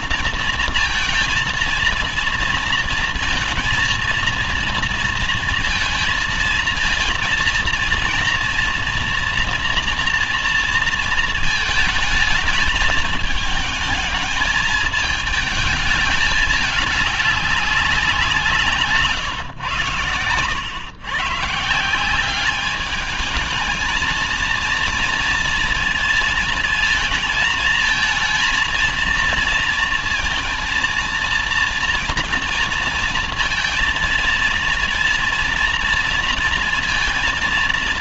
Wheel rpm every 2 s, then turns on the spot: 230, 230, 230, 230, 240, 230, 220, 220, 210, 170, 100, 200, 230, 230, 220, 230, 230, 230, 230.
none